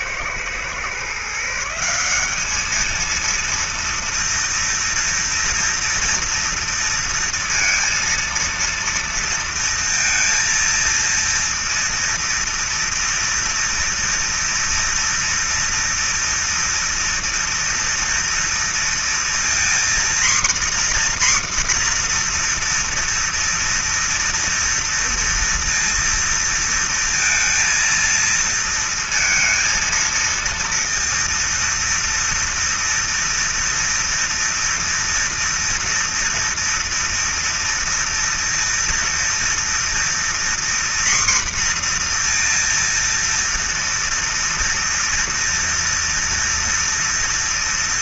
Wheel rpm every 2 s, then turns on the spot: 120, 190, 230, 230, 230, 230, 230, 230, 230, 230, 250, 250, 230, 230, 230, 230, 230, 230, 230, 230, 240, 240, 230, 230.
none